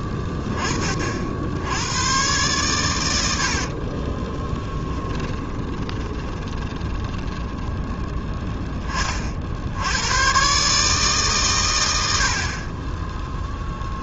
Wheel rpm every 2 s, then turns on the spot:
30, 120, 20, 20, 10, 120, 50.
4-8